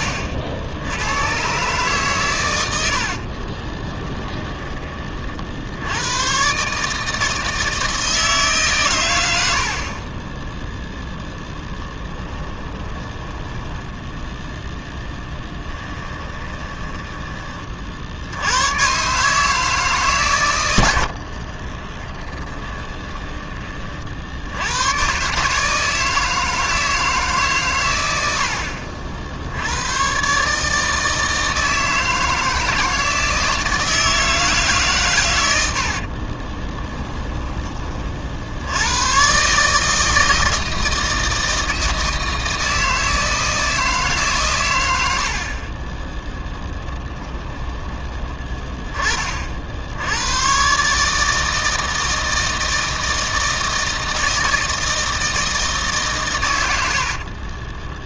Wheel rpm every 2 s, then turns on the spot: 80, 90, 20, 150, 130, 0, 10, 10, 20, 110, 100, 20, 100, 160, 70, 150, 160, 140, 20, 90, 160, 160, 100, 10, 20, 130, 160, 160, 80.
2-4 12-14 16-18 22-24 36-38 46-48 56-58